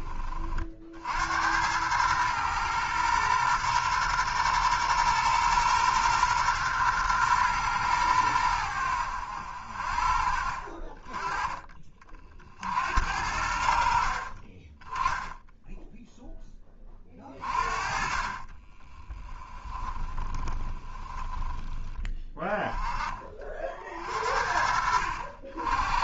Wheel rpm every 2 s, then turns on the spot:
50, 120, 120, 120, 90, 40, 60, 20, 20, 30, 20, 10, 60.
18-22